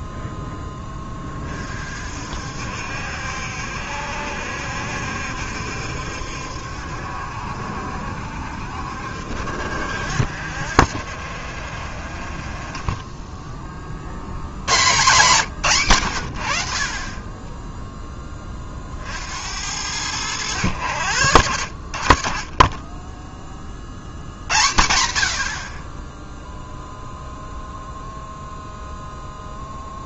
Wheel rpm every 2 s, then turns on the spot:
10, 60, 70, 70, 60, 50, 30, 120, 60, 30, 90, 20, 100, 0, 0.
none